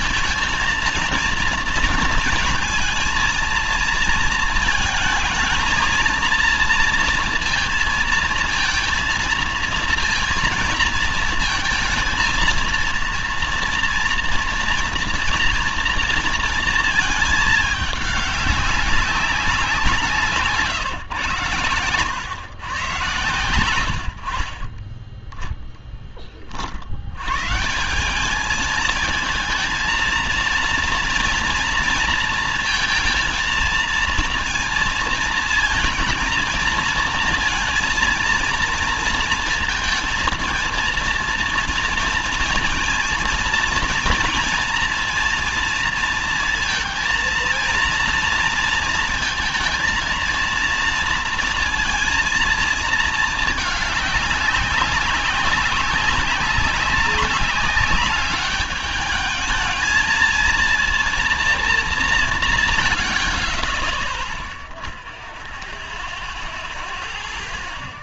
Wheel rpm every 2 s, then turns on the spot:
230, 230, 220, 230, 230, 230, 230, 230, 230, 200, 140, 120, 20, 60, 210, 230, 220, 230, 230, 230, 230, 230, 230, 230, 230, 230, 230, 200, 190, 210, 230, 140, 0, 0.
none